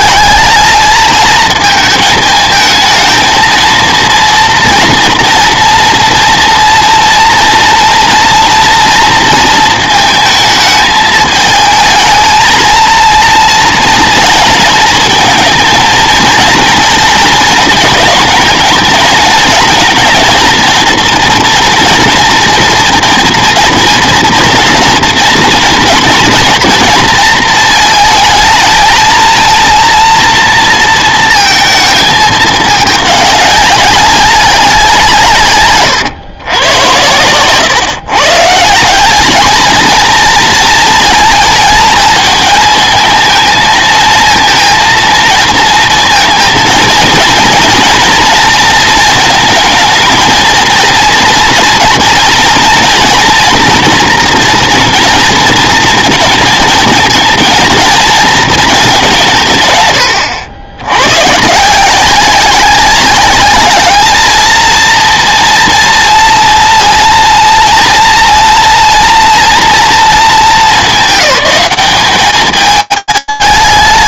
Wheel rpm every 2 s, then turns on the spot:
210, 220, 230, 230, 240, 220, 230, 220, 220, 220, 230, 230, 230, 230, 220, 230, 210, 180, 100, 160, 230, 210, 230, 230, 230, 230, 230, 240, 220, 220, 90, 190, 230, 230, 230, 210, 210.
none